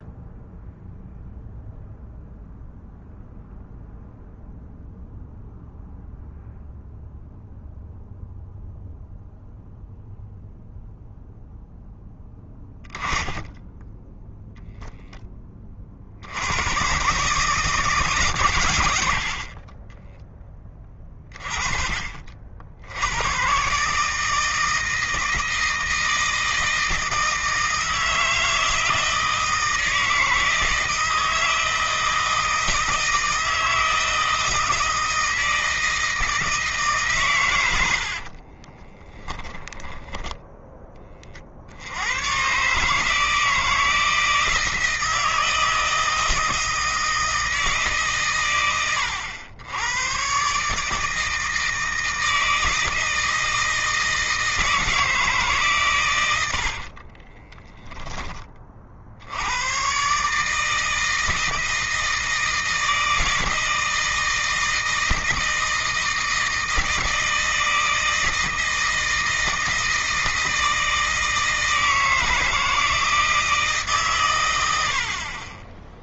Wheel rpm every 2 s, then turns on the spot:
0, 0, 0, 0, 0, 0, 10, 10, 100, 100, 20, 70, 160, 160, 160, 160, 160, 160, 150, 40, 20, 140, 160, 160, 110, 150, 160, 160, 60, 40, 160, 160, 160, 160, 160, 160, 160, 80.
38-40 56-58